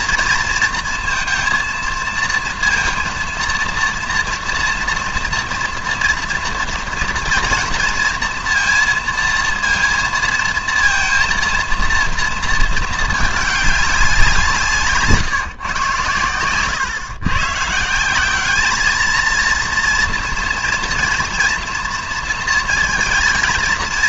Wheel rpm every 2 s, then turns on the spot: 230, 230, 230, 230, 230, 230, 220, 160, 120, 210, 230, 230.
16-18